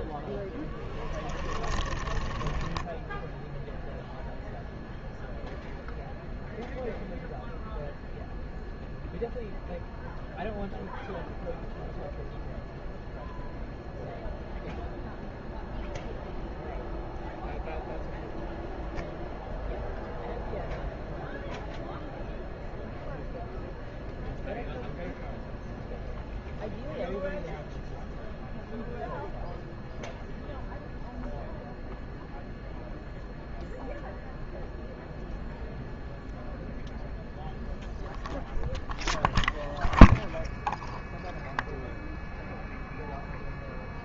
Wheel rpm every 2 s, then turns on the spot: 10, 10, 0, 0, 0, 0, 0, 0, 0, 0, 0, 0, 0, 0, 0, 0, 0, 0, 0, 0, 0, 0.
0-4